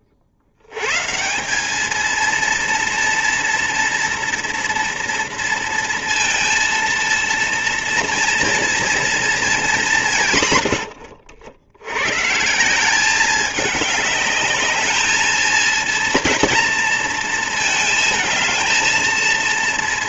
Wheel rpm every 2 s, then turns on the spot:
90, 230, 230, 230, 230, 100, 170, 220, 230, 220.
10-12